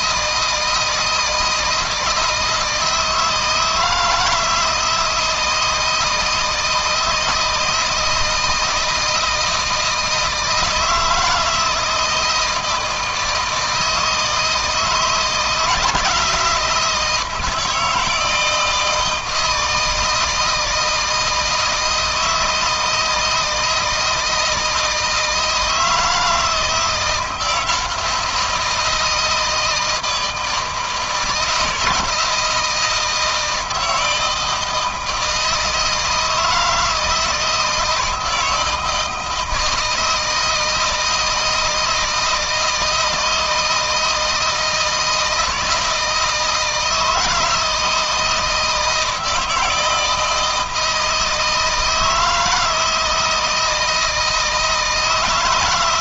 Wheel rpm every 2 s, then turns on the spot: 160, 160, 160, 160, 160, 160, 160, 160, 170, 160, 160, 160, 160, 170, 160, 160, 160, 160, 160, 160, 160, 160, 160, 160, 170, 160, 160, 160.
none